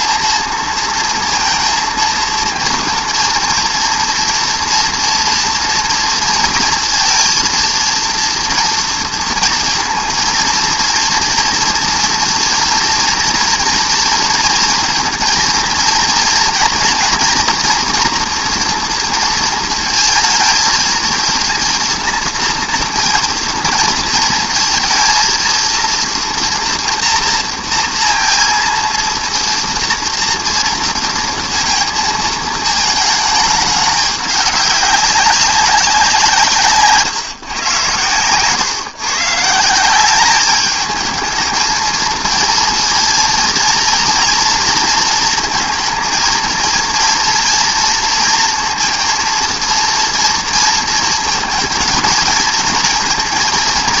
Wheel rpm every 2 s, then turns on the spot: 230, 230, 230, 230, 230, 230, 230, 230, 230, 230, 230, 230, 230, 230, 230, 230, 220, 200, 140, 140, 220, 230, 230, 230, 230, 230, 230.
none